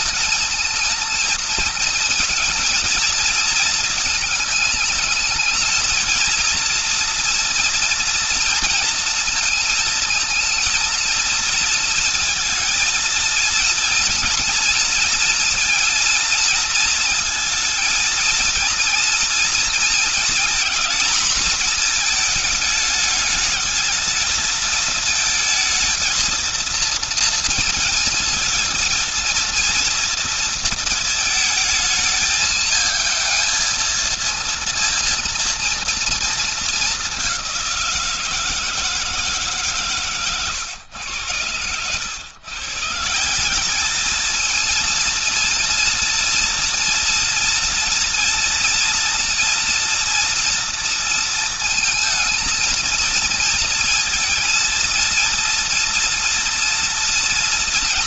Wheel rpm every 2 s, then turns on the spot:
230, 230, 220, 230, 230, 230, 230, 230, 230, 230, 230, 210, 220, 230, 230, 220, 220, 230, 200, 160, 110, 170, 230, 230, 230, 230, 230, 230, 240.
none